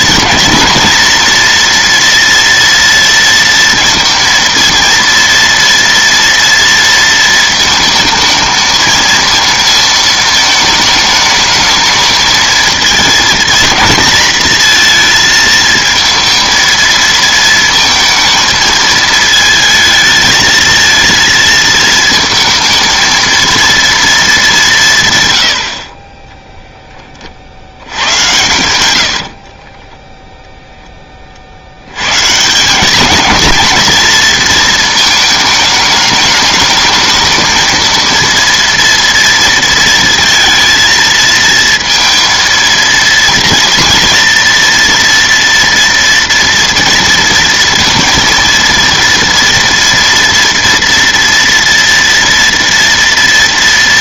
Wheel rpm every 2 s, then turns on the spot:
230, 230, 230, 230, 220, 220, 220, 230, 230, 220, 220, 220, 180, 10, 90, 10, 200, 220, 210, 230, 230, 230, 230, 230, 230, 230, 230.
none